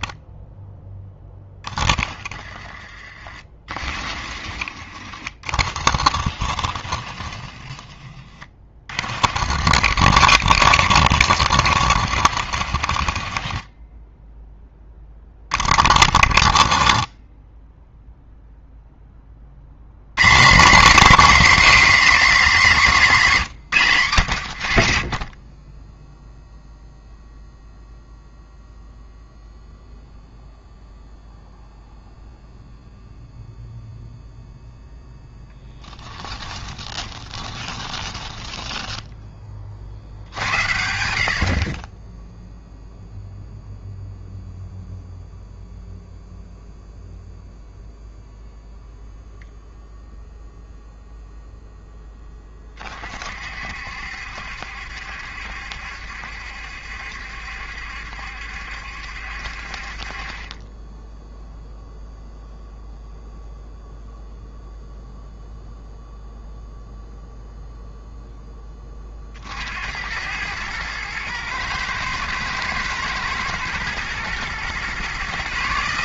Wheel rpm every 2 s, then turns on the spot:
0, 20, 30, 30, 30, 60, 50, 10, 30, 0, 230, 230, 60, 0, 0, 0, 0, 0, 10, 10, 70, 0, 0, 0, 0, 0, 30, 70, 70, 70, 20, 0, 0, 0, 20, 110, 120, 130.
2-4 6-8 36-40